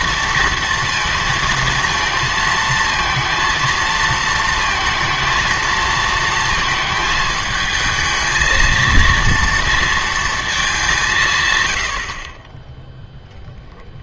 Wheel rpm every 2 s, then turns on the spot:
230, 230, 230, 220, 230, 190, 10.
none